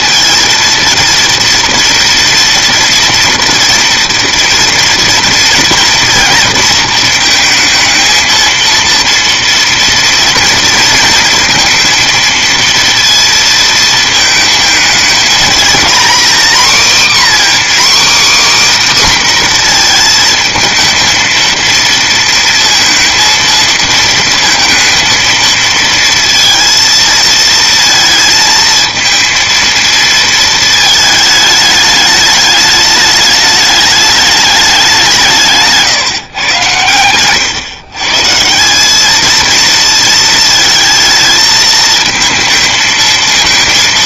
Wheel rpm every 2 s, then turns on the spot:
230, 230, 230, 230, 230, 230, 230, 220, 250, 280, 230, 230, 220, 230, 220, 220, 210, 200, 120, 170, 220, 220.
none